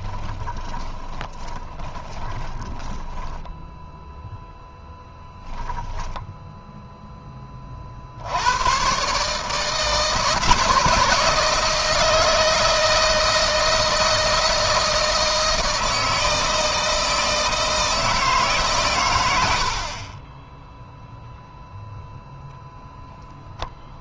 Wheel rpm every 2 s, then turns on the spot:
20, 10, 0, 10, 130, 160, 160, 160, 160, 110, 0, 0.
0-2